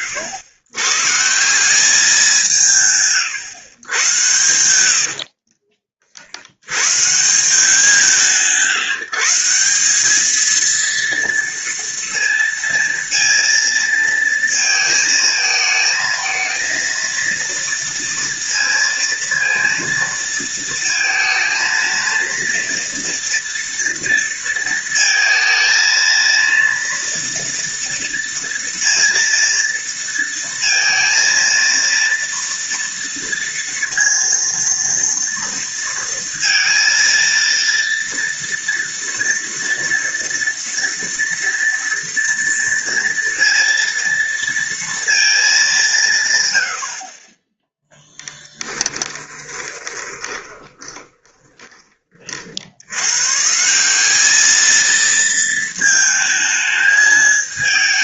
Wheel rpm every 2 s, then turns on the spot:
110, 150, 80, 110, 160, 230, 230, 220, 230, 230, 230, 230, 230, 230, 230, 230, 230, 230, 230, 230, 230, 230, 230, 70, 10, 20, 70, 220, 220.
48-52